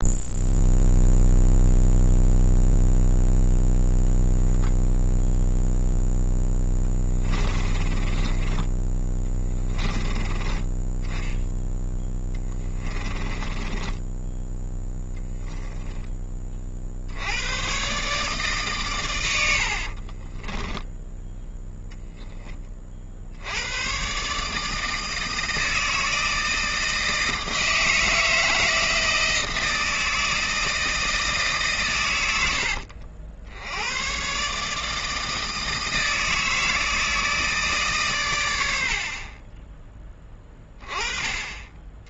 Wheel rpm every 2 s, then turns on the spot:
0, 0, 10, 10, 20, 10, 20, 10, 30, 140, 10, 20, 150, 160, 160, 160, 80, 150, 160, 80, 20.
6-10 12-14 20-22